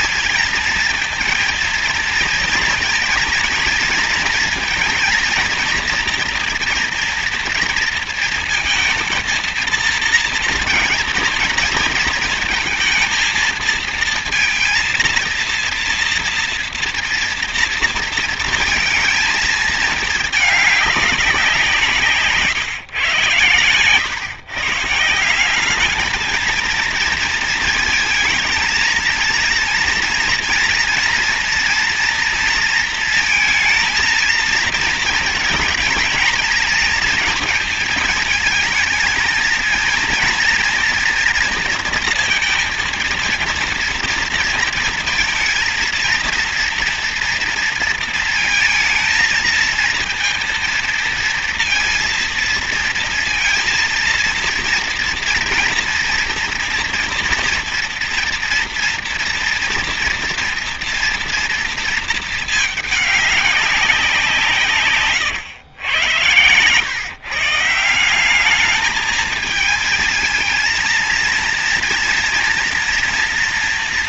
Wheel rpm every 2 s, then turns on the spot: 220, 230, 230, 240, 230, 240, 220, 230, 230, 230, 210, 130, 150, 230, 230, 230, 230, 230, 220, 230, 230, 230, 230, 230, 230, 230, 230, 230, 230, 230, 240, 210, 140, 130, 210, 230, 230.
64-66